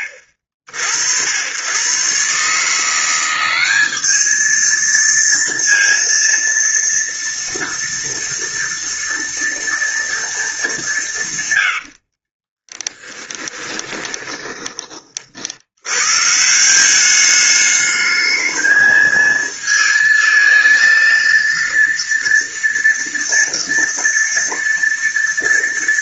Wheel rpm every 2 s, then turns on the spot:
70, 160, 220, 230, 230, 200, 20, 30, 180, 220, 230, 230, 230.
12-14